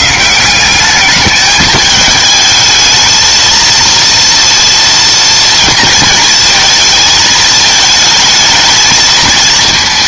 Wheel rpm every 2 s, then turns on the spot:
180, 220, 230, 230, 220.
none